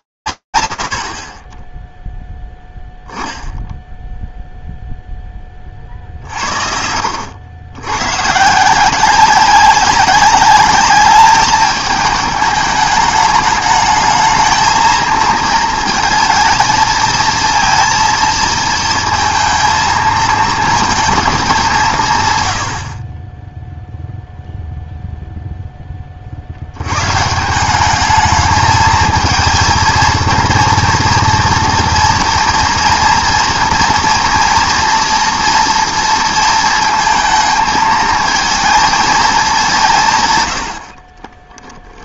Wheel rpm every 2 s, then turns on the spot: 0, 10, 70, 190, 210, 210, 220, 220, 230, 230, 40, 0, 70, 220, 230, 230, 230, 230, 230, 120, 10.
40-42